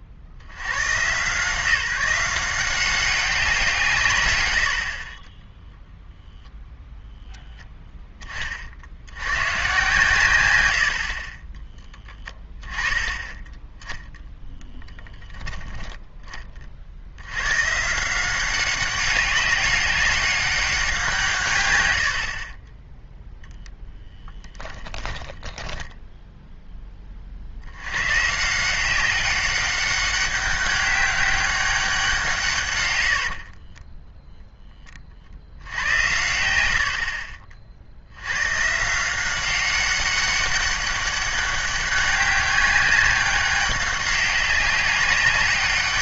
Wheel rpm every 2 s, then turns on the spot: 90, 180, 70, 0, 50, 100, 20, 0, 30, 190, 190, 30, 10, 10, 170, 200, 140, 10, 90, 130, 200, 200, 200.
22-26